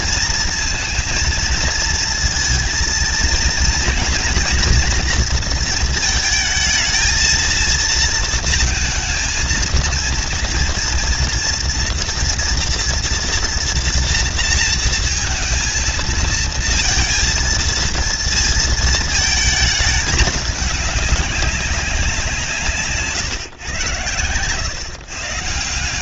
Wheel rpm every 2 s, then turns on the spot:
230, 230, 230, 220, 230, 230, 230, 230, 230, 230, 210, 180, 120.
none